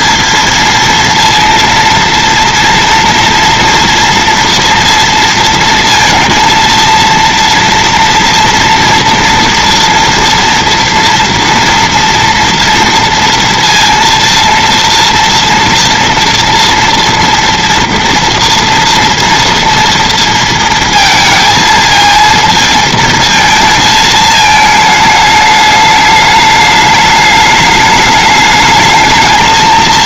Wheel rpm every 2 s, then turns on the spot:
230, 230, 230, 230, 230, 230, 230, 230, 230, 230, 230, 220, 220, 210, 220.
none